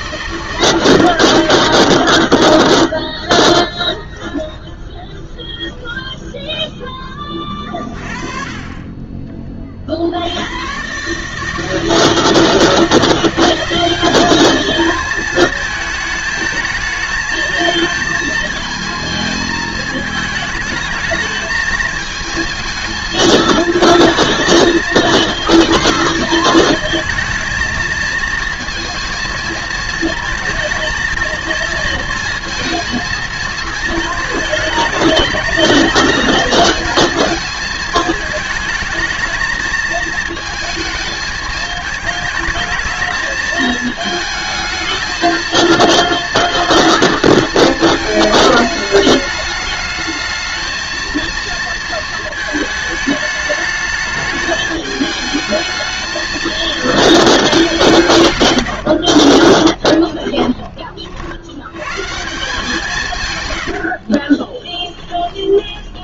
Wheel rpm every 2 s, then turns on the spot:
140, 10, 10, 0, 30, 120, 170, 220, 220, 230, 220, 220, 230, 220, 230, 220, 230, 220, 230, 220, 220, 220, 220, 230, 220, 220, 220, 210, 230, 80, 30, 170, 10.
8-10 58-60 64-66